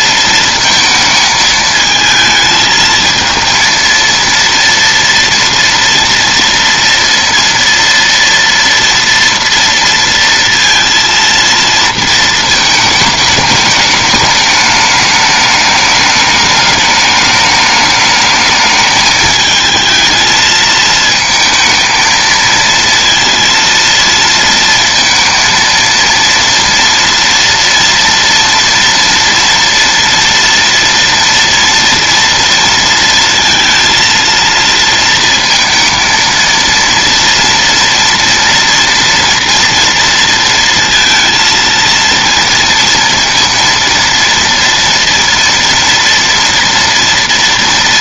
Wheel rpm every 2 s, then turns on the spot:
220, 220, 230, 230, 230, 230, 220, 210, 210, 220, 220, 230, 230, 230, 230, 240, 230, 230, 230, 230, 230, 230, 230, 230.
none